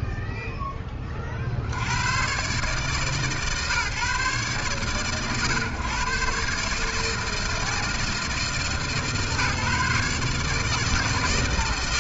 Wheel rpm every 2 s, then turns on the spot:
40, 130, 120, 160, 150, 160.
none